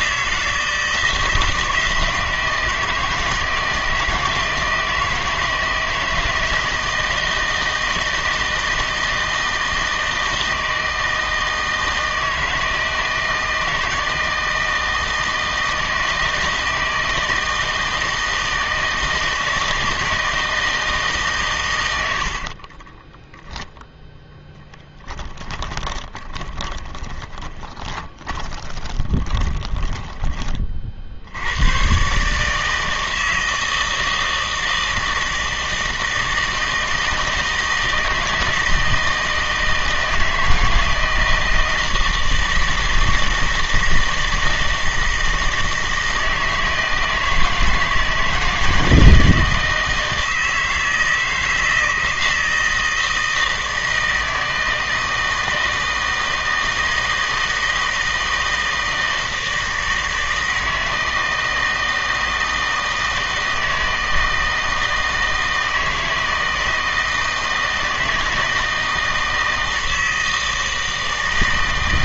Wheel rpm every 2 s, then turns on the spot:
160, 160, 160, 160, 160, 160, 160, 160, 160, 160, 160, 20, 10, 20, 20, 40, 160, 160, 160, 160, 160, 160, 160, 160, 160, 160, 160, 160, 160, 160, 160, 160, 160, 160, 160, 160.
22-30